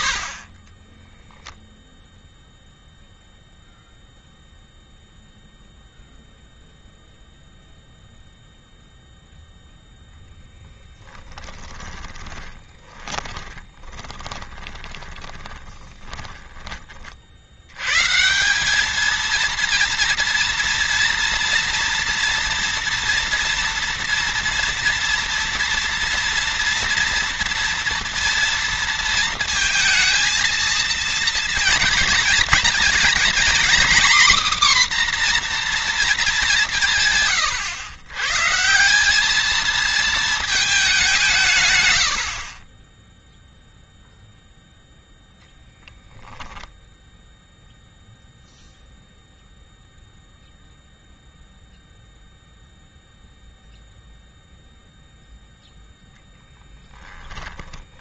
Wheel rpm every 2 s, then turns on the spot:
20, 0, 0, 0, 0, 10, 20, 20, 30, 210, 230, 230, 230, 230, 230, 230, 230, 260, 160, 170, 200, 20, 0, 0, 0, 0, 0, 0, 10.
0-2 12-16 56-58